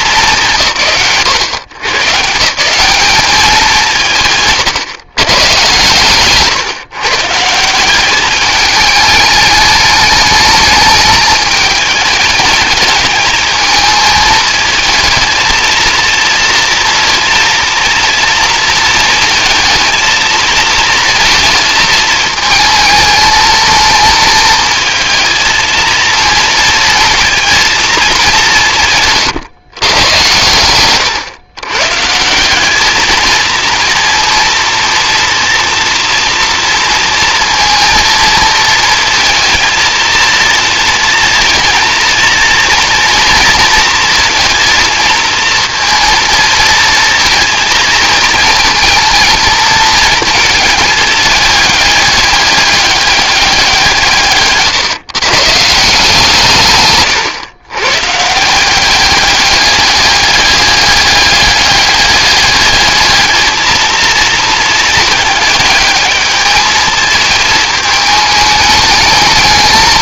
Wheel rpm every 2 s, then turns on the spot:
130, 190, 140, 140, 210, 210, 220, 220, 230, 220, 230, 220, 220, 230, 160, 110, 210, 230, 230, 230, 230, 230, 230, 220, 230, 220, 200, 140, 140, 190, 200, 210, 220, 220, 210.
none